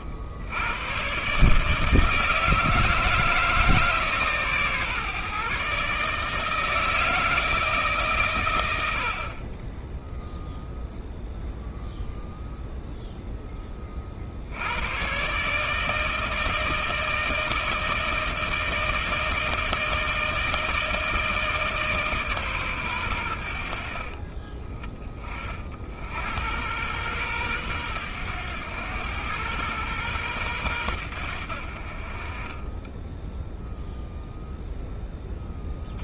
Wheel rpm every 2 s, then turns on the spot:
100, 160, 140, 160, 70, 0, 0, 90, 160, 160, 160, 130, 30, 100, 110, 110, 20, 10.
none